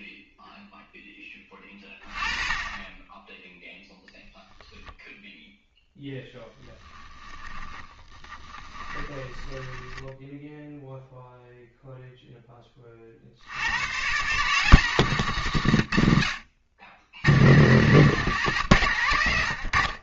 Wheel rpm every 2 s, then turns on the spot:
10, 20, 0, 10, 20, 0, 30, 150, 90, 120.
6-10